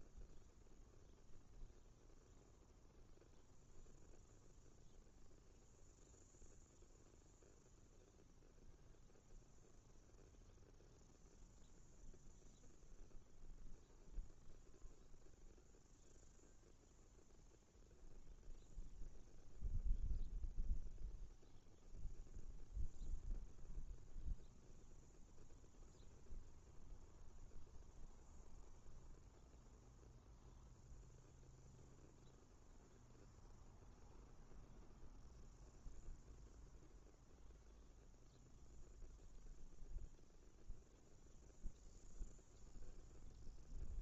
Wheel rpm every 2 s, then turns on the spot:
0, 0, 0, 0, 0, 0, 0, 0, 0, 0, 0, 0, 0, 0, 0, 0, 0, 0, 0, 0, 0, 0.
none